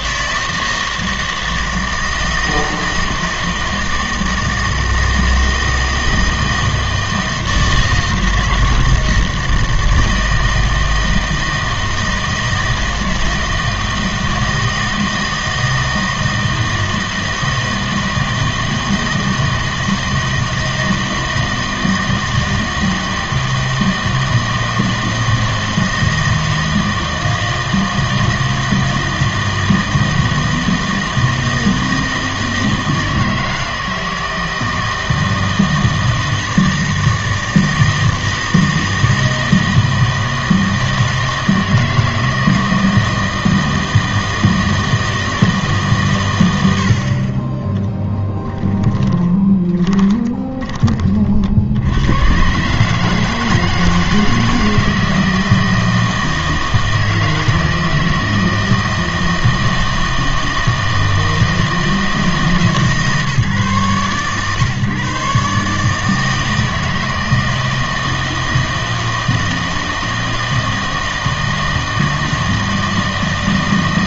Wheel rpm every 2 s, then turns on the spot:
160, 160, 160, 160, 160, 160, 160, 160, 160, 160, 160, 160, 160, 160, 160, 160, 160, 160, 160, 160, 160, 160, 160, 100, 20, 20, 130, 160, 160, 160, 160, 150, 130, 160, 160, 160, 160.
48-52